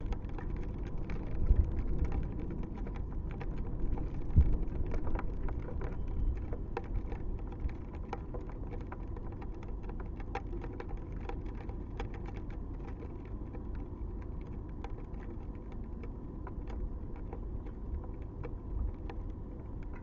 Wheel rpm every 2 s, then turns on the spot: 0, 0, 0, 0, 0, 0, 0, 0, 0, 0.
none